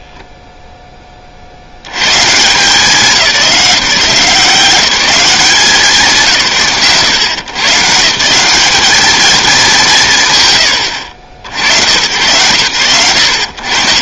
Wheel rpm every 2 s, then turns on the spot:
20, 180, 180, 140, 220, 70, 100.
none